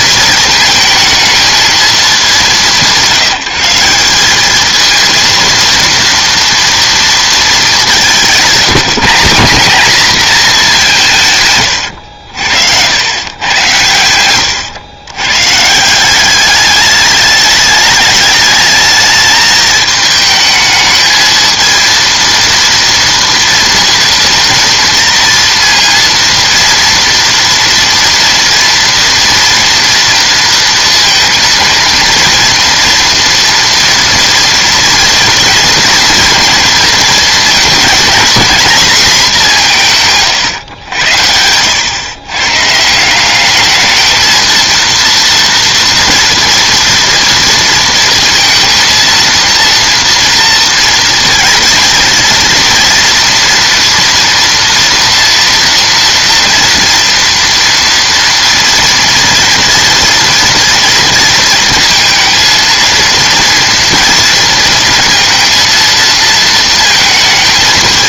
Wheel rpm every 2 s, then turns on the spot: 220, 170, 230, 220, 200, 130, 110, 130, 210, 220, 220, 230, 230, 230, 230, 230, 230, 230, 230, 200, 90, 200, 230, 230, 230, 220, 230, 230, 230, 230, 230, 230, 230, 220.
none